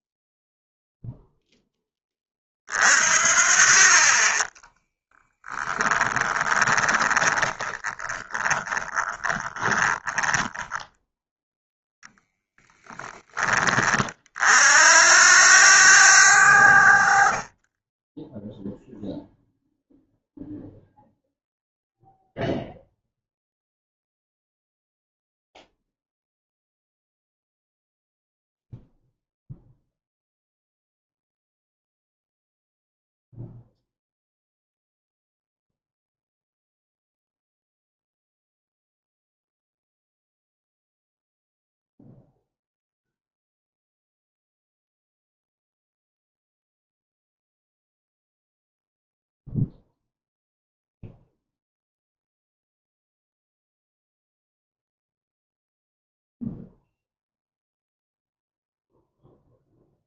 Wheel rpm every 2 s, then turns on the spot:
0, 30, 20, 20, 20, 20, 0, 50, 80, 10, 0, 0, 0, 0, 0, 0, 0, 0, 0, 0, 0, 0, 0, 0, 0, 0, 0, 0, 0, 0.
4-12